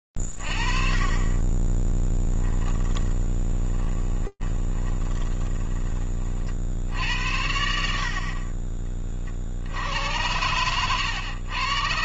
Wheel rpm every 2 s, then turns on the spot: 20, 20, 20, 30, 60, 90.
2-6